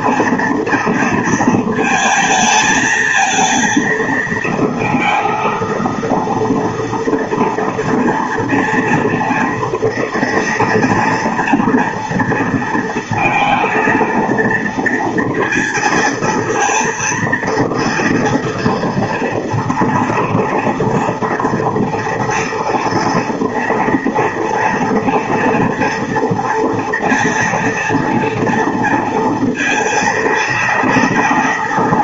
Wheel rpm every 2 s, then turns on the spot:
230, 230, 230, 230, 230, 230, 230, 230, 230, 230, 230, 230, 230, 230, 230, 230.
none